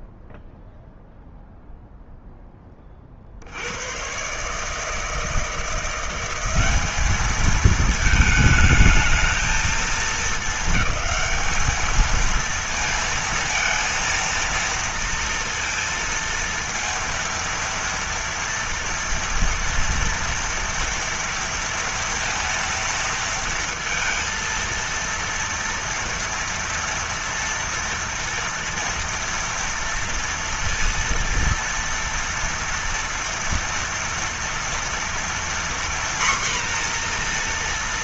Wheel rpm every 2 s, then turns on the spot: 0, 20, 140, 190, 220, 220, 230, 230, 230, 230, 230, 230, 230, 230, 230, 230, 230, 230, 250.
none